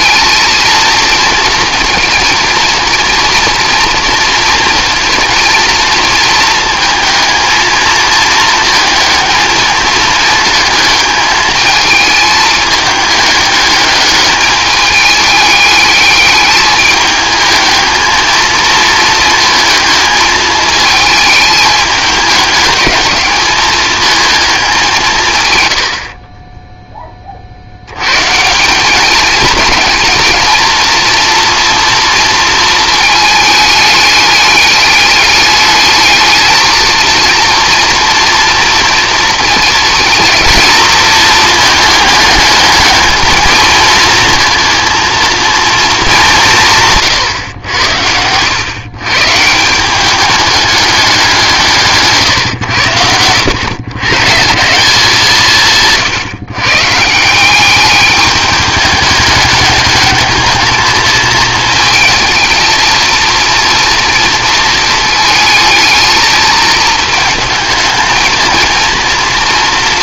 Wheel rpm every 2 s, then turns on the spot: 230, 230, 230, 230, 220, 220, 210, 210, 210, 230, 220, 210, 200, 10, 180, 230, 220, 210, 220, 230, 230, 210, 230, 170, 120, 210, 110, 180, 140, 210, 220, 230, 220, 220, 230.
none